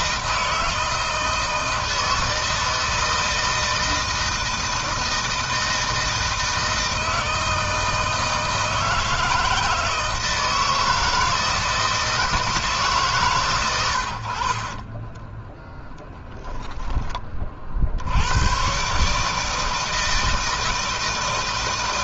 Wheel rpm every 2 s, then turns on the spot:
160, 160, 160, 160, 160, 160, 160, 30, 10, 110, 160.
14-16